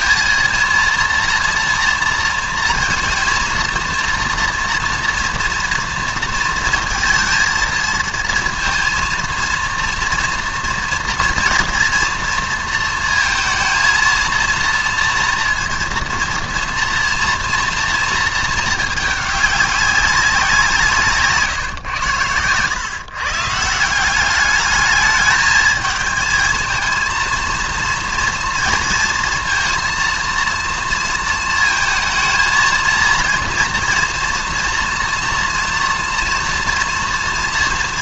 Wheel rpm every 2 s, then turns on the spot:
230, 230, 230, 230, 230, 230, 230, 230, 230, 220, 180, 110, 210, 220, 230, 230, 230, 230, 230.
none